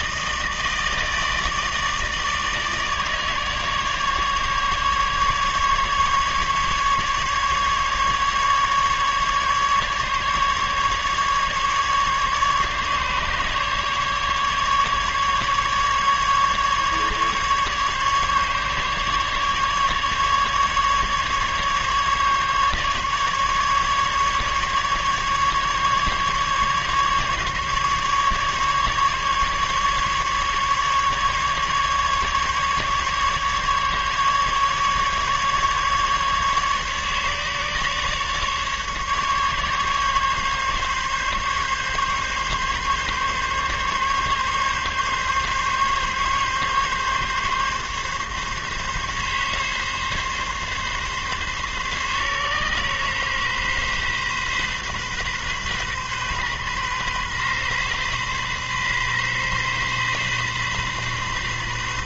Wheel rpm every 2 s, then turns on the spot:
160, 150, 150, 150, 150, 150, 150, 140, 140, 150, 150, 150, 150, 150, 140, 150, 150, 150, 150, 150, 140, 140, 140, 140, 140, 140, 130, 130, 130, 130, 130.
none